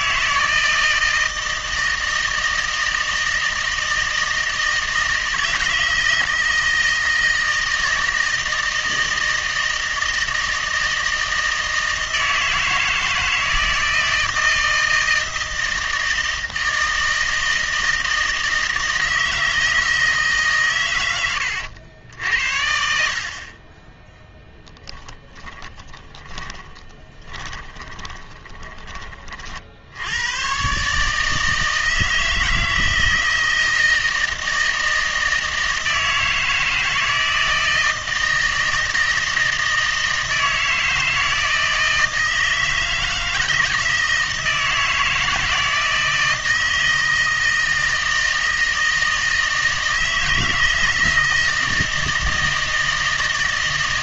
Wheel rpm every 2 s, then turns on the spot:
160, 160, 160, 160, 160, 160, 160, 160, 160, 160, 120, 60, 10, 20, 20, 140, 160, 160, 160, 160, 160, 160, 160, 160, 160, 160, 160.
24-28